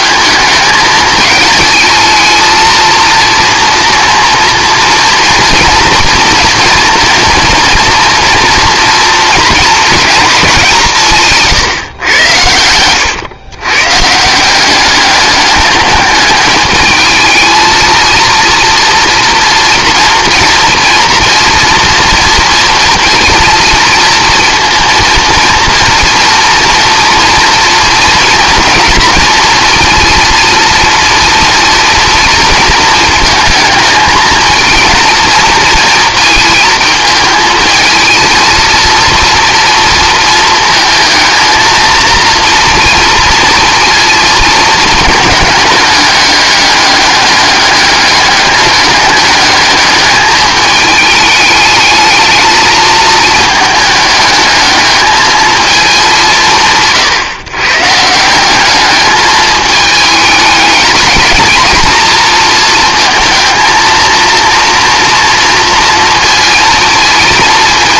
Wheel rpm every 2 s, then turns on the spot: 220, 230, 230, 230, 230, 170, 110, 200, 210, 230, 240, 230, 230, 230, 230, 230, 220, 220, 220, 230, 230, 230, 220, 200, 210, 210, 220, 210, 150, 210, 210, 230, 230, 230.
none